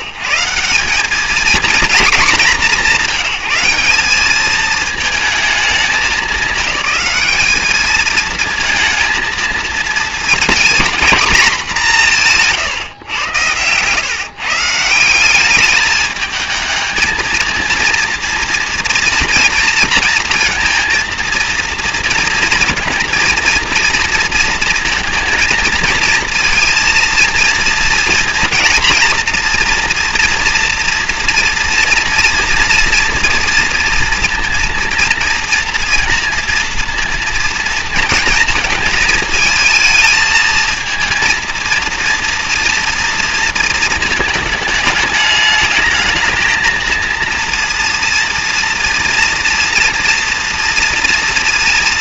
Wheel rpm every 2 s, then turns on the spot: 110, 180, 210, 210, 220, 230, 170, 140, 220, 230, 230, 230, 230, 230, 230, 240, 230, 230, 230, 220, 220, 230, 220, 220, 230, 230.
12-14